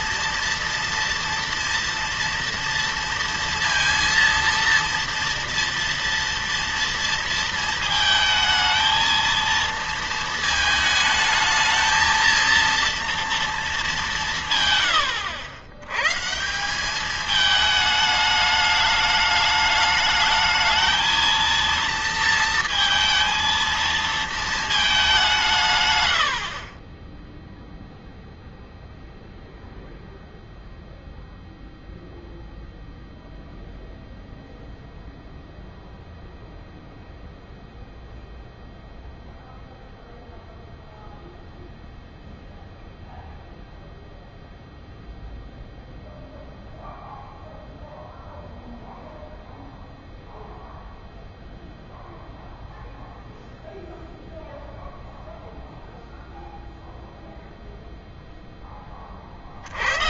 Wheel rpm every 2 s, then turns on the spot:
230, 230, 230, 230, 220, 220, 230, 130, 170, 210, 220, 230, 220, 40, 0, 0, 0, 0, 0, 0, 0, 0, 0, 0, 0, 0, 0, 0, 0, 10.
none